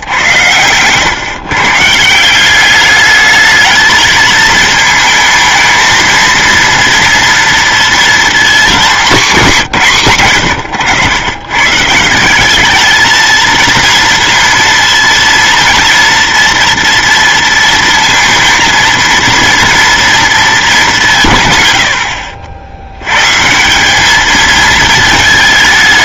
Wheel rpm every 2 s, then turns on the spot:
110, 190, 220, 230, 220, 90, 210, 230, 230, 230, 200, 80, 220.
none